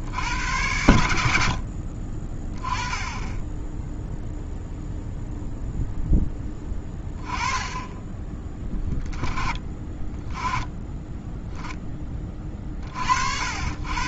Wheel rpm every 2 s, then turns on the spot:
60, 30, 0, 10, 20, 20, 30.
none